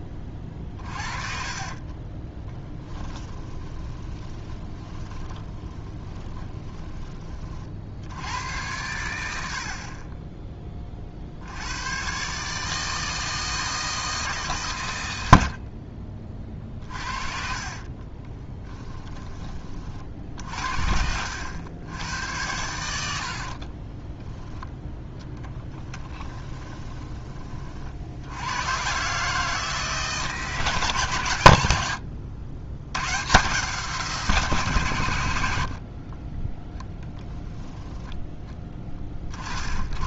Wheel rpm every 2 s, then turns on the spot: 30, 20, 20, 20, 100, 30, 150, 120, 50, 10, 60, 90, 0, 20, 110, 150, 60, 140, 10, 20.
2-6 16-20 26-28